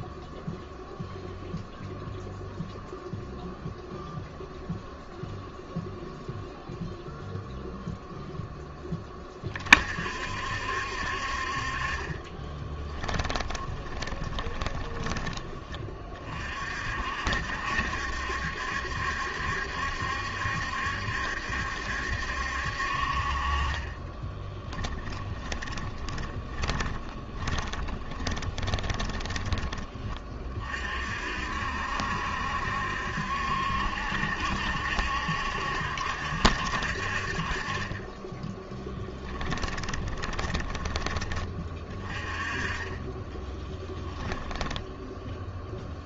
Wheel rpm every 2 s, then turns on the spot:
0, 0, 0, 0, 10, 60, 10, 20, 50, 70, 70, 60, 20, 30, 20, 50, 70, 70, 60, 10, 20, 20, 0.
12-16 24-30 38-40